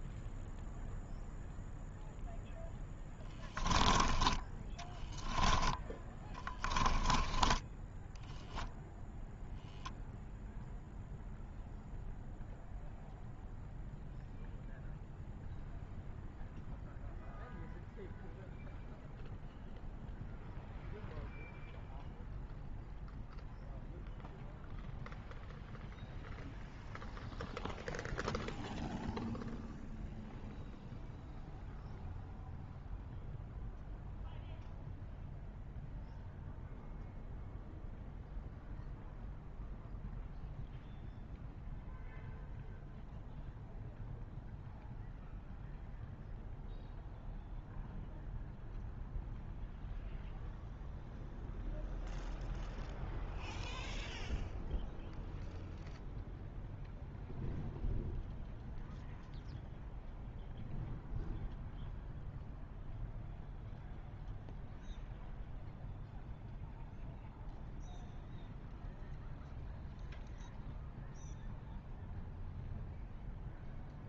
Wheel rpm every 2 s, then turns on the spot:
0, 0, 10, 20, 0, 0, 0, 0, 0, 0, 0, 0, 0, 0, 0, 0, 0, 0, 0, 0, 0, 0, 0, 0, 0, 0, 0, 0, 0, 0, 0, 0, 0, 0, 0, 0, 0.
6-8